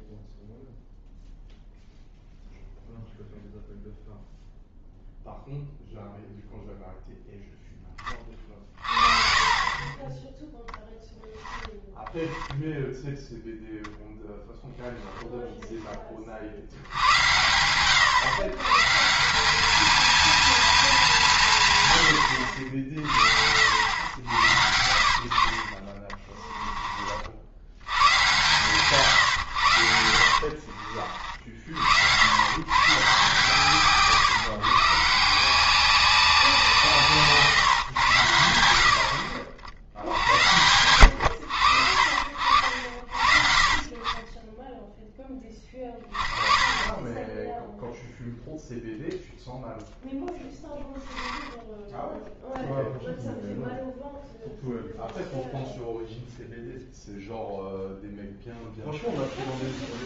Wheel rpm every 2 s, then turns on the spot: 0, 0, 0, 0, 30, 0, 0, 0, 60, 130, 220, 60, 70, 20, 120, 50, 120, 130, 180, 70, 90, 60, 10, 20, 0, 0, 0, 0, 0, 0.
24-28 30-32